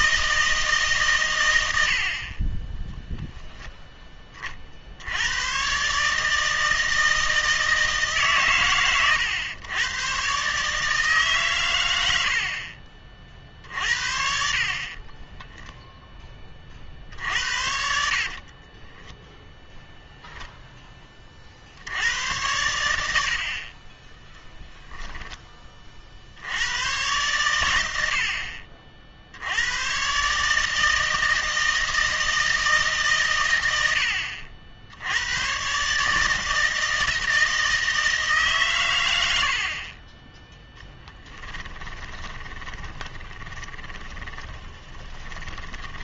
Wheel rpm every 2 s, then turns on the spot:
150, 10, 50, 160, 120, 150, 40, 40, 50, 20, 10, 100, 0, 110, 50, 150, 150, 70, 160, 130, 10, 20, 20.
18-20 40-46